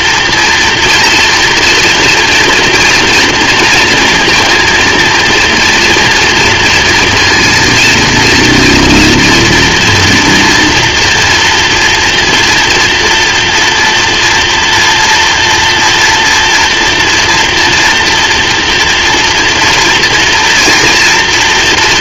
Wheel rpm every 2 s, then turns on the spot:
240, 230, 230, 230, 240, 230, 230, 230, 240, 240, 230.
none